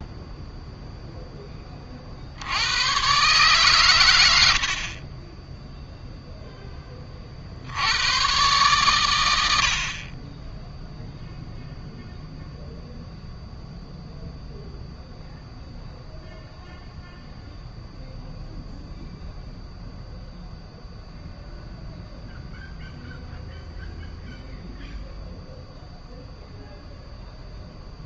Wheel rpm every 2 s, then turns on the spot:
0, 80, 80, 10, 110, 20, 0, 0, 0, 0, 0, 0, 0, 0.
none